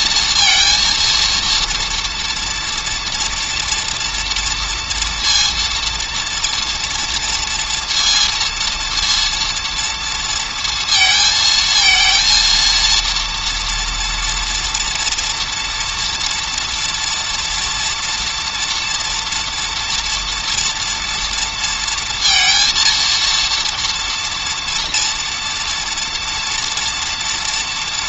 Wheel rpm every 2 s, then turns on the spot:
230, 230, 240, 230, 230, 230, 230, 230, 240, 240, 230, 230, 230, 230.
none